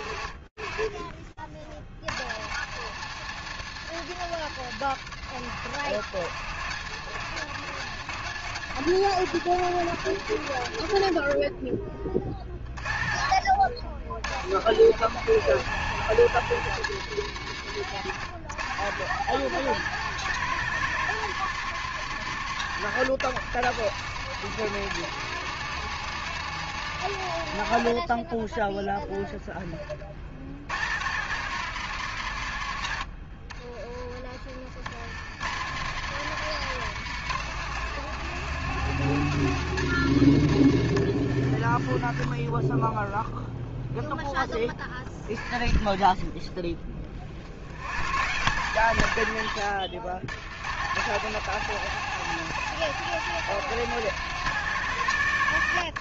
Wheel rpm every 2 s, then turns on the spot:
60, 120, 120, 130, 120, 40, 90, 130, 130, 160, 140, 160, 160, 30, 90, 130, 60, 160, 130, 110, 20, 30, 30, 120, 90, 170, 180, 150.
40-42